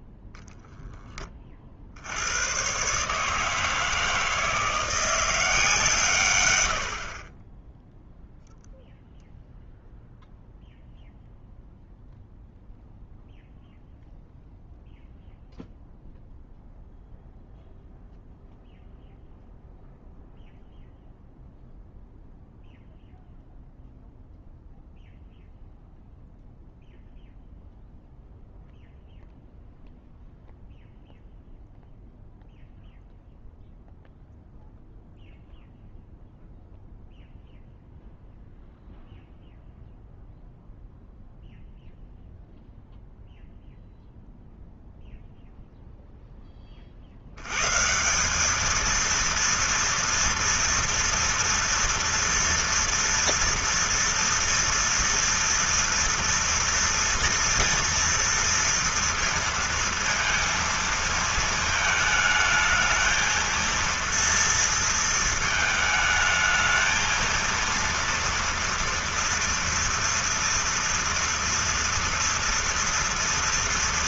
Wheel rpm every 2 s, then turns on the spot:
0, 110, 160, 100, 0, 0, 0, 0, 0, 0, 0, 0, 0, 0, 0, 0, 0, 0, 0, 0, 0, 0, 0, 20, 210, 240, 230, 230, 230, 230, 230, 220, 230, 220, 230, 230, 230.
none